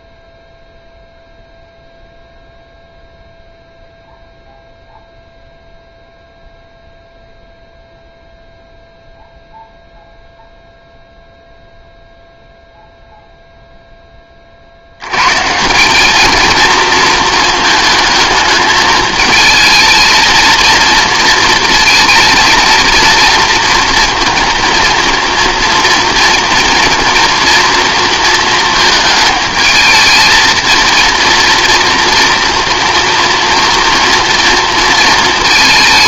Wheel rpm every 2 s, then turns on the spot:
0, 0, 0, 0, 0, 0, 0, 60, 230, 220, 230, 230, 230, 240, 220, 230, 230, 230.
none